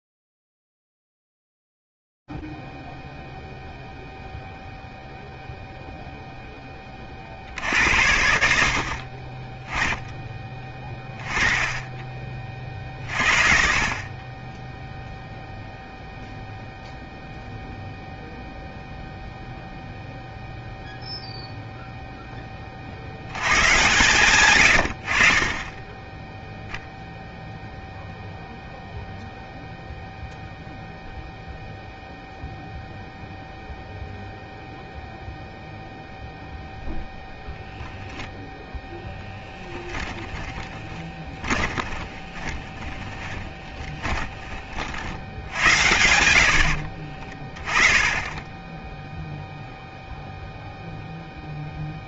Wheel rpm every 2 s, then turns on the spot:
0, 0, 0, 0, 60, 20, 30, 10, 0, 0, 0, 10, 130, 0, 0, 0, 0, 0, 0, 0, 10, 20, 20, 80, 10, 0.
40-44